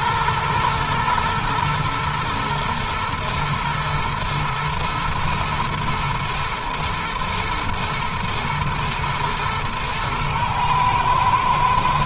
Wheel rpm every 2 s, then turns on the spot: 110, 120, 110, 110, 110, 120.
none